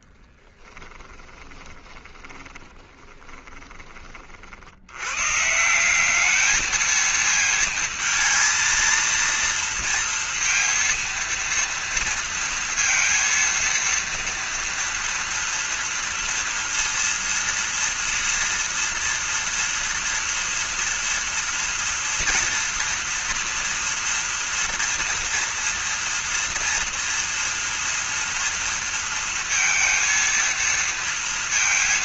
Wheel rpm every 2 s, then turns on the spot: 20, 20, 80, 220, 230, 230, 230, 230, 230, 230, 230, 230, 230, 240, 230, 230.
0-4